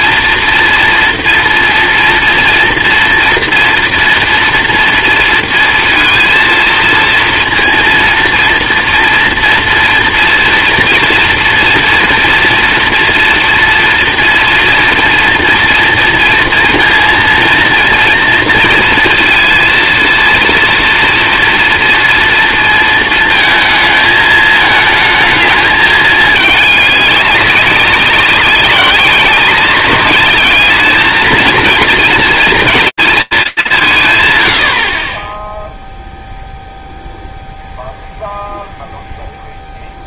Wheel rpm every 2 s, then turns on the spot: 230, 230, 230, 230, 230, 230, 240, 230, 230, 230, 230, 230, 220, 210, 190, 220, 220, 70, 0, 0.
none